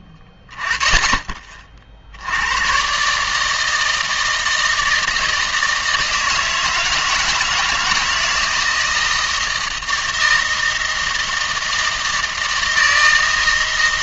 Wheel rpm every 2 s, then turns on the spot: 20, 110, 160, 160, 170, 160, 160.
none